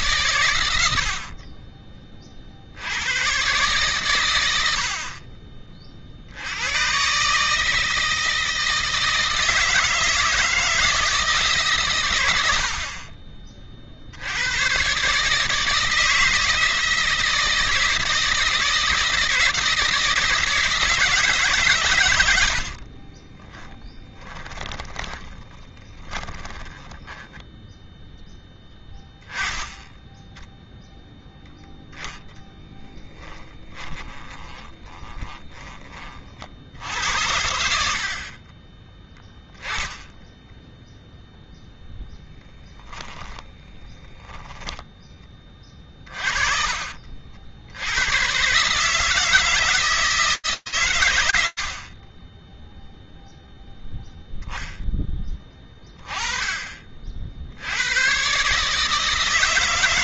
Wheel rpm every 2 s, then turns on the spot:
120, 50, 110, 80, 160, 160, 90, 90, 160, 160, 160, 90, 20, 20, 10, 10, 10, 20, 50, 30, 10, 10, 10, 30, 140, 160, 30, 10, 20, 140.
22-28 32-36 42-46